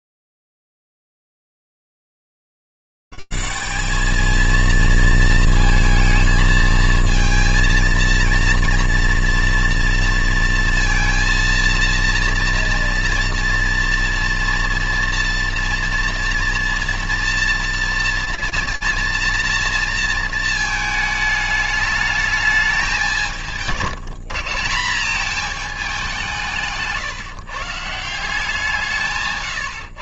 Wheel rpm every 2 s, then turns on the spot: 40, 80, 170, 220, 230, 230, 230, 230, 240, 230, 230, 210, 170, 190, 170.
none